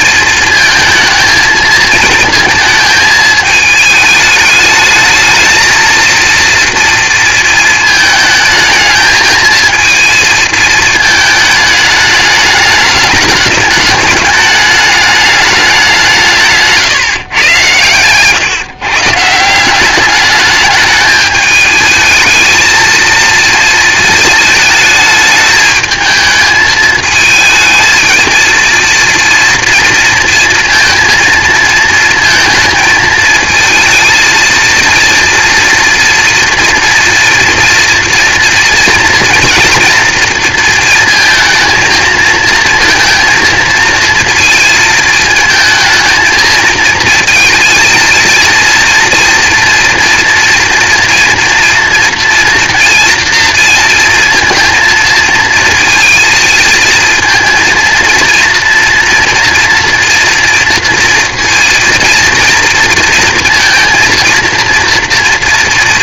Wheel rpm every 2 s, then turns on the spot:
230, 220, 210, 230, 220, 220, 210, 210, 150, 140, 210, 220, 210, 220, 230, 230, 220, 230, 240, 230, 230, 230, 220, 220, 230, 230, 230, 230, 230, 230, 230, 230, 230.
none